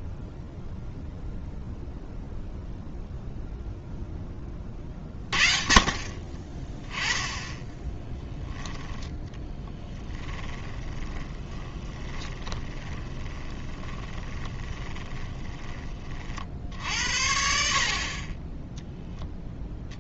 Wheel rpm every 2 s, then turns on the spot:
70, 0, 20, 30, 10, 10, 20, 20, 50, 10.
10-16